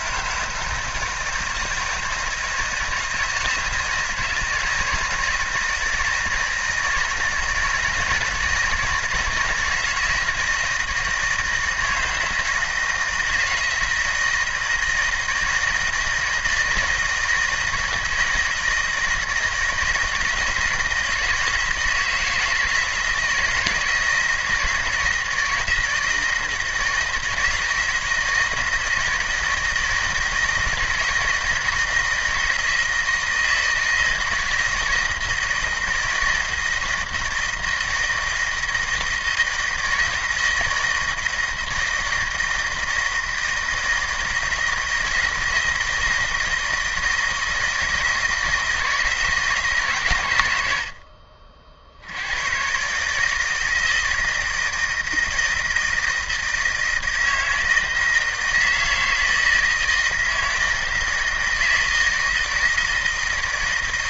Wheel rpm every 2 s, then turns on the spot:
160, 160, 160, 160, 160, 160, 160, 160, 160, 160, 160, 160, 160, 160, 160, 160, 160, 160, 160, 160, 160, 160, 160, 160, 160, 80, 120, 160, 160, 160, 160, 160.
none